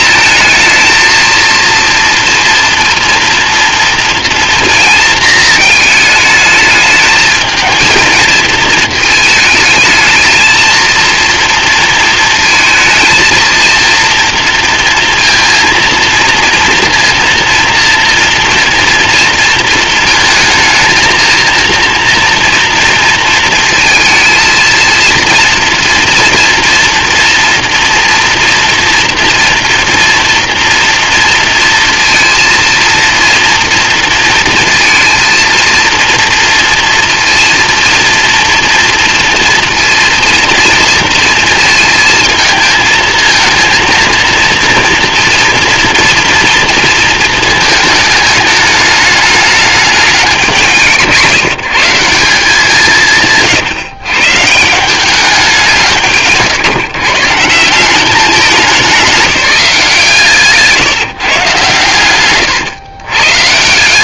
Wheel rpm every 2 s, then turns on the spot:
220, 230, 230, 210, 220, 220, 220, 230, 230, 230, 230, 230, 230, 230, 230, 230, 230, 230, 230, 230, 230, 220, 240, 230, 210, 170, 170, 170, 170, 200, 160, 110.
none